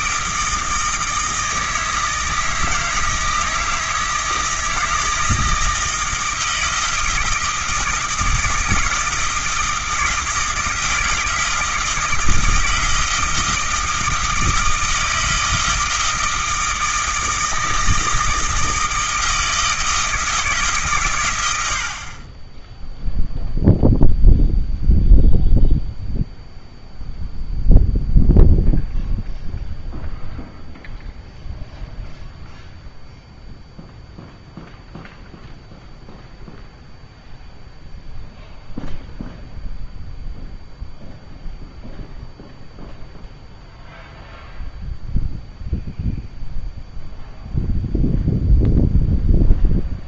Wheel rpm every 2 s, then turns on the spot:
160, 160, 160, 160, 160, 160, 160, 160, 160, 160, 150, 10, 0, 0, 0, 0, 0, 0, 0, 0, 0, 0, 0, 0, 0.
none